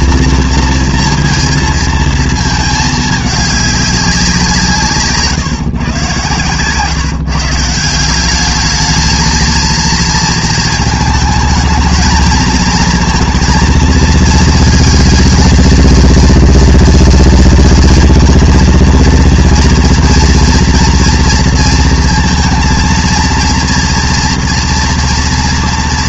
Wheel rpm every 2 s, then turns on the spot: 230, 220, 170, 120, 200, 220, 220, 230, 230, 230, 230, 230, 240.
none